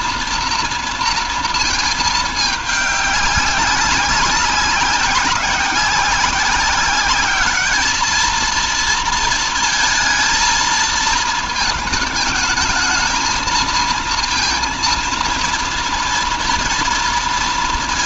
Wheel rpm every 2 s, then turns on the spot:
230, 210, 190, 190, 230, 230, 220, 230, 240.
none